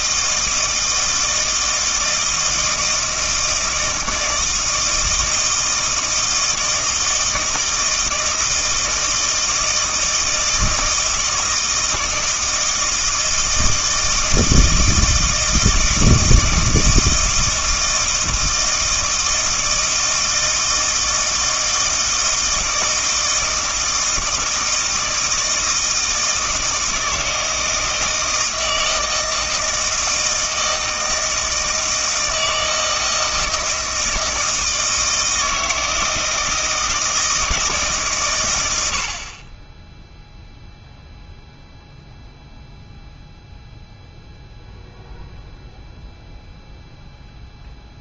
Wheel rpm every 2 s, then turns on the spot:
160, 160, 160, 160, 160, 160, 160, 160, 160, 160, 160, 160, 160, 160, 160, 160, 160, 160, 160, 80, 0, 0, 0, 0.
none